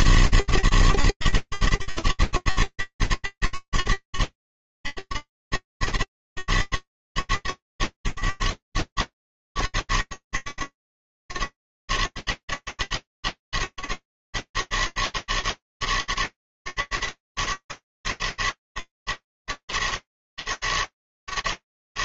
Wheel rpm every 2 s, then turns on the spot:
110, 100, 110, 110, 90, 110, 110, 110, 110, 100, 110.
none